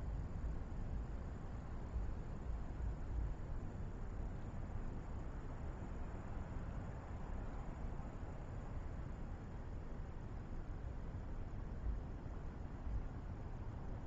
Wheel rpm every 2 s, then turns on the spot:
0, 0, 0, 0, 0, 0, 0.
none